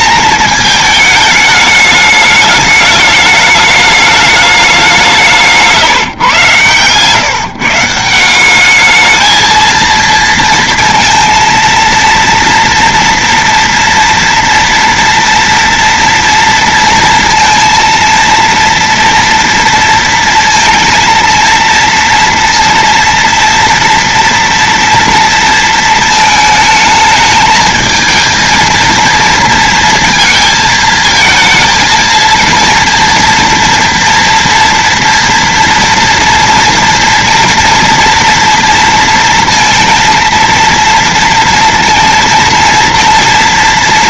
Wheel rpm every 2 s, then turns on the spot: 220, 210, 210, 140, 180, 230, 230, 230, 230, 230, 230, 230, 230, 220, 220, 230, 230, 240, 230, 230, 230, 230.
none